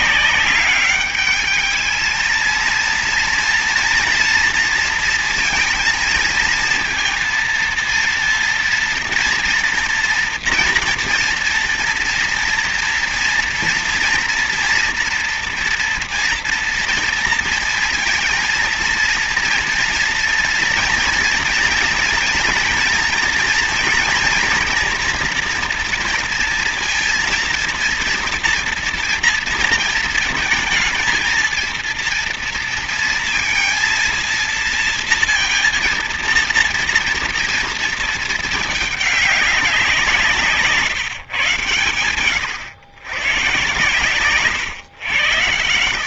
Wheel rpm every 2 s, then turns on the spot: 200, 230, 230, 230, 230, 230, 230, 230, 230, 230, 230, 230, 230, 230, 240, 230, 230, 230, 230, 220, 160, 110, 110.
none